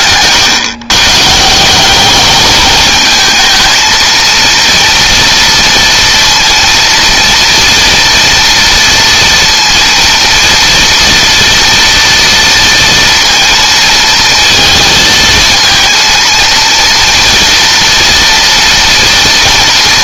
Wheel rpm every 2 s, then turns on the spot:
140, 220, 230, 230, 230, 230, 230, 230, 230, 230.
none